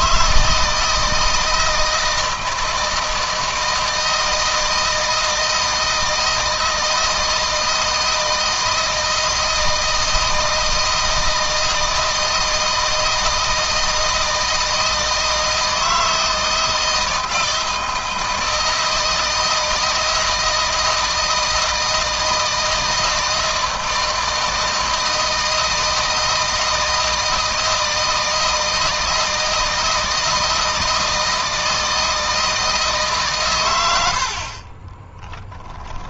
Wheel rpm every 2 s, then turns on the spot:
160, 160, 160, 160, 160, 160, 160, 160, 160, 160, 160, 160, 160, 160, 160, 160, 150, 20.
34-36